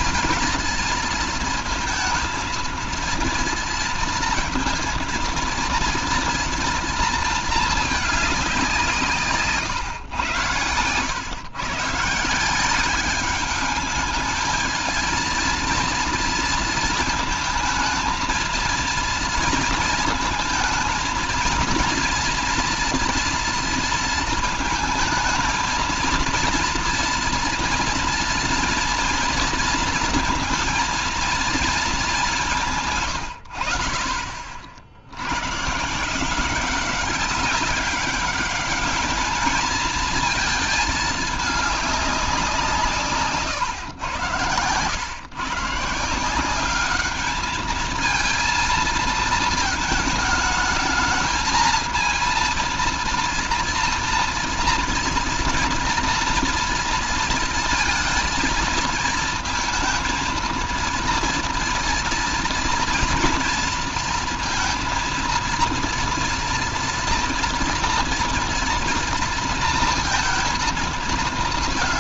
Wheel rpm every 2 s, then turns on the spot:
230, 230, 230, 230, 190, 110, 190, 220, 220, 230, 230, 230, 230, 230, 230, 230, 170, 50, 190, 200, 220, 180, 120, 190, 230, 210, 230, 230, 230, 230, 230, 230, 230, 230, 230, 230.
none